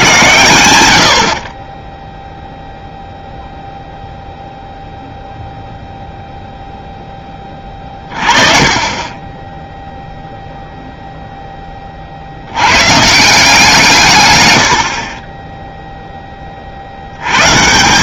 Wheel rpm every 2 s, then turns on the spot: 60, 0, 0, 10, 40, 10, 180, 20, 130.
none